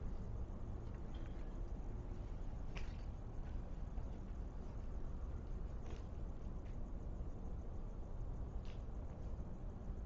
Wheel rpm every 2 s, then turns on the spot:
0, 0, 0, 0, 0.
none